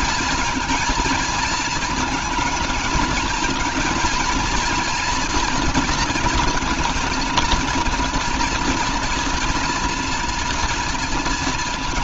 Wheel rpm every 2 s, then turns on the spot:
220, 220, 230, 220, 230, 230.
none